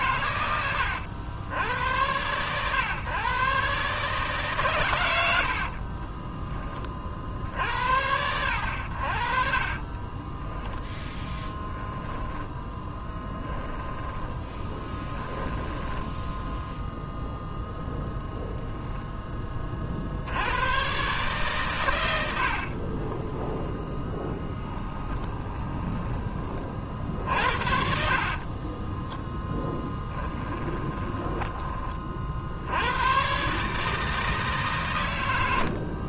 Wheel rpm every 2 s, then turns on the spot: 100, 120, 120, 20, 80, 10, 10, 10, 0, 0, 110, 50, 10, 30, 30, 20, 80, 140.
10-16 22-26 28-32